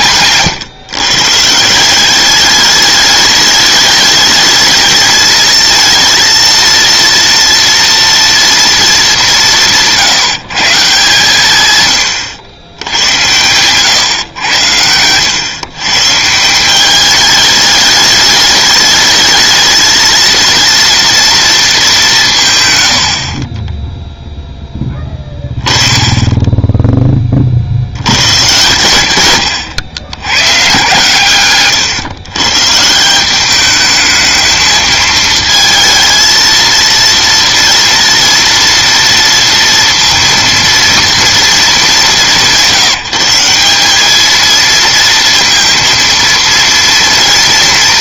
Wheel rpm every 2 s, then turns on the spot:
140, 210, 220, 230, 230, 160, 100, 100, 190, 210, 230, 130, 10, 10, 120, 120, 140, 220, 230, 230, 230, 180, 230, 230.
14-16